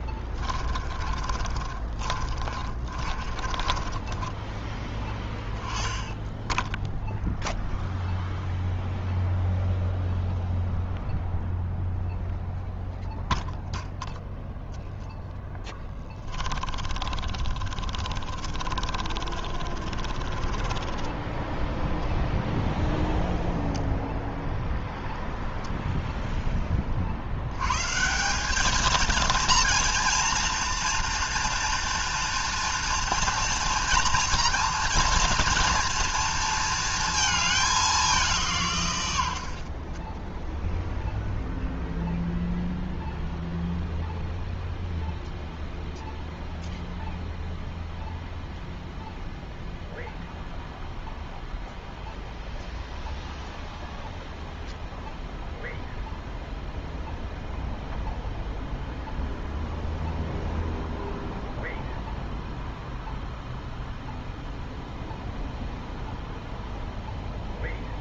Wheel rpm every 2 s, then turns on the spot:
20, 40, 10, 10, 0, 0, 0, 0, 20, 40, 20, 0, 0, 20, 200, 230, 230, 230, 230, 150, 0, 0, 0, 0, 0, 0, 0, 0, 0, 0, 0, 0, 0, 0.
0-4 16-22